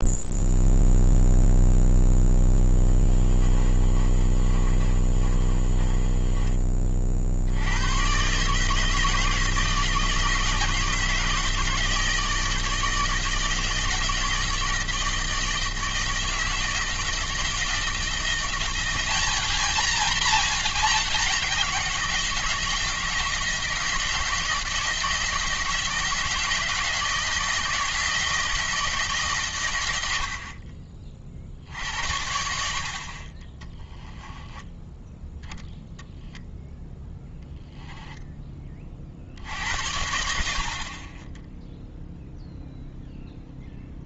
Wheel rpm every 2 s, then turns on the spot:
0, 20, 30, 50, 160, 160, 160, 160, 160, 200, 200, 170, 160, 160, 150, 30, 50, 10, 0, 50, 30, 0.
2-6